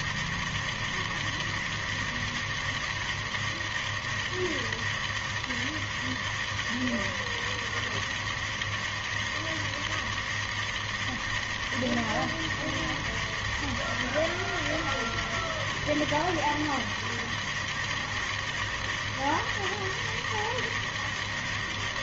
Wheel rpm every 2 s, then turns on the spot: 160, 160, 160, 160, 160, 160, 160, 160, 160, 160, 160.
none